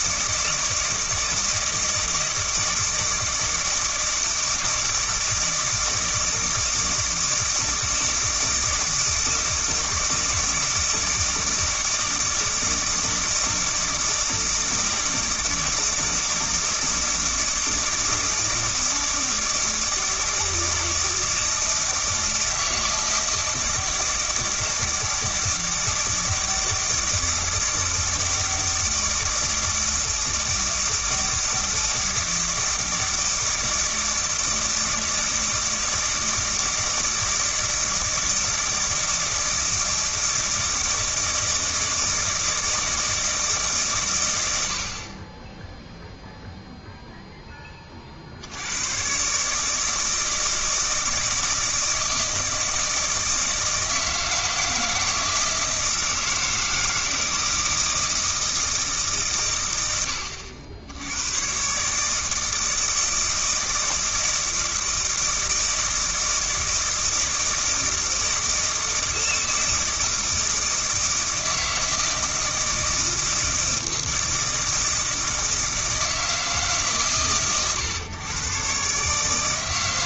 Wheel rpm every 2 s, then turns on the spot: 160, 160, 160, 160, 160, 160, 160, 160, 160, 160, 160, 160, 160, 160, 160, 160, 160, 160, 160, 160, 160, 160, 80, 0, 90, 160, 160, 160, 160, 160, 80, 160, 160, 160, 160, 160, 160, 160, 150, 130.
none